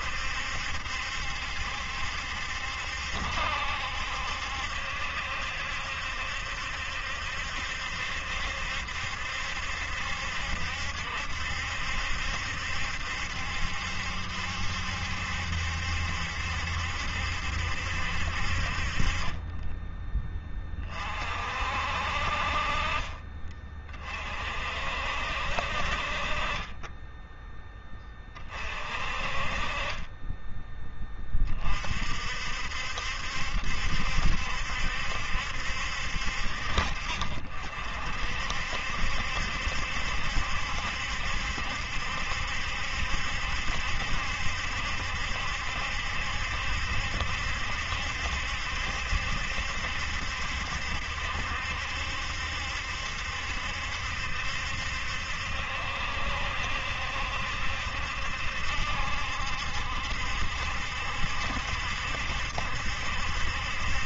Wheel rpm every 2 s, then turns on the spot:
70, 70, 70, 70, 70, 70, 70, 70, 70, 30, 40, 30, 60, 20, 40, 20, 70, 70, 60, 60, 70, 70, 70, 70, 70, 70, 70, 70, 70, 70, 70, 70.
none